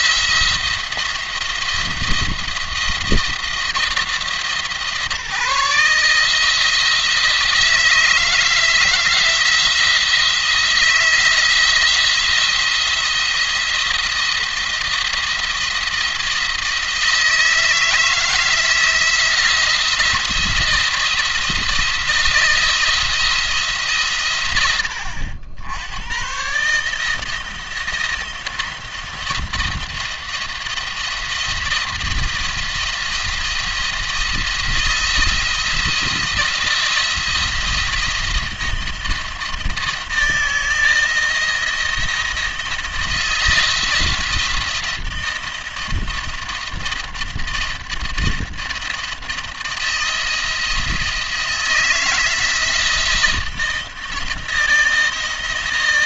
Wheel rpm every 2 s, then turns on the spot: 170, 170, 150, 160, 170, 160, 170, 170, 160, 160, 170, 170, 90, 140, 170, 170, 170, 170, 160, 170, 160, 170, 170, 170, 170, 160, 160, 160.
none